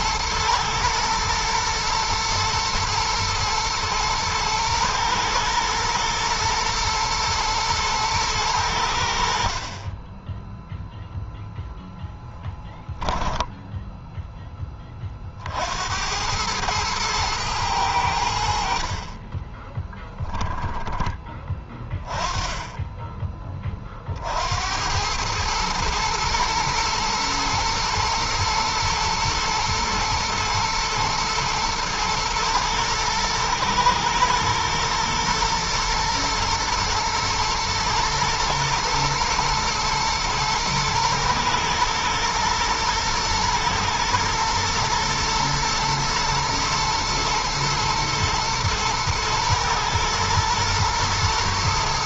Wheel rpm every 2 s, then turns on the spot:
110, 110, 120, 120, 70, 10, 10, 30, 110, 50, 20, 10, 90, 110, 120, 110, 110, 110, 120, 110, 110, 120, 110, 120, 120, 110.
12-14